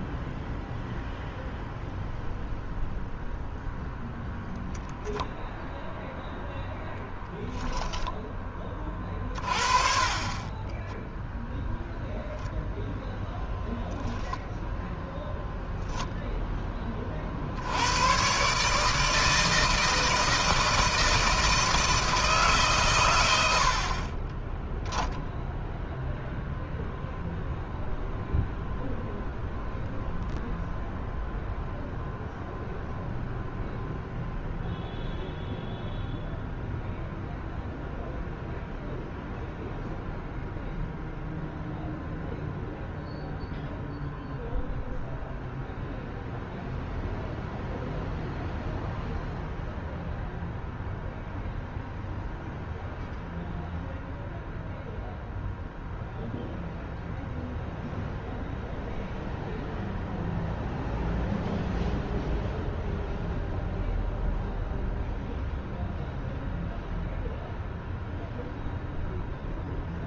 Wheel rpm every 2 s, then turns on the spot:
0, 0, 0, 0, 30, 20, 0, 0, 30, 150, 160, 120, 0, 0, 0, 0, 0, 0, 0, 0, 0, 0, 0, 0, 0, 0, 0, 0, 0, 0, 0, 0, 0, 0, 0.
10-12